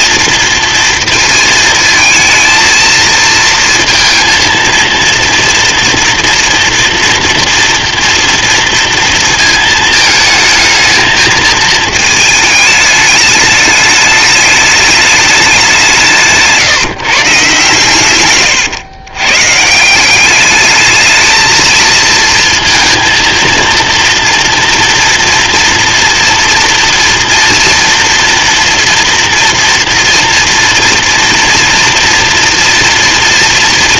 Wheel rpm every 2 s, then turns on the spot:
230, 230, 230, 240, 230, 220, 210, 210, 160, 130, 210, 230, 230, 230, 240, 230, 230.
none